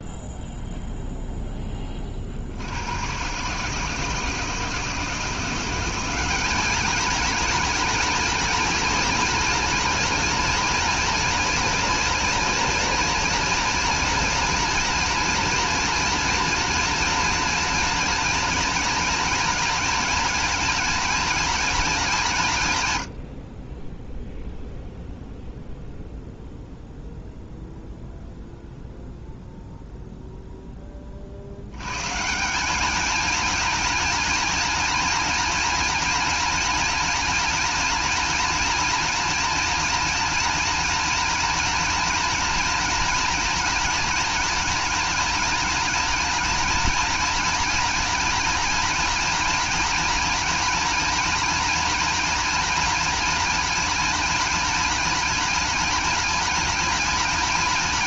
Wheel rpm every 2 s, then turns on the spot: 0, 110, 160, 220, 230, 230, 230, 230, 230, 230, 230, 100, 0, 0, 0, 30, 220, 230, 230, 230, 230, 230, 230, 230, 230, 230, 230, 230, 230.
none